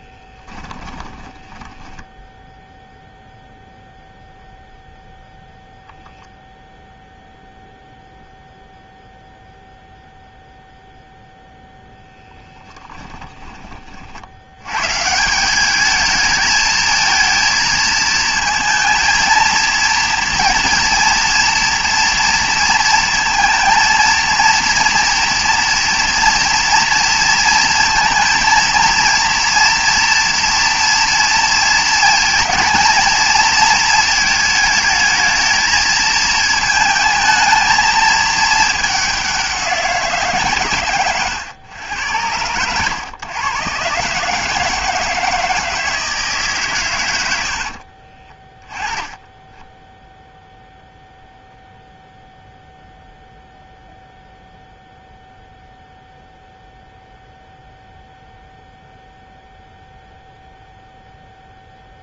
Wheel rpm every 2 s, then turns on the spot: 20, 0, 0, 0, 0, 0, 20, 140, 220, 230, 230, 230, 230, 230, 230, 230, 230, 220, 220, 200, 120, 110, 160, 110, 10, 0, 0, 0, 0, 0, 0.
0-2 12-14 40-42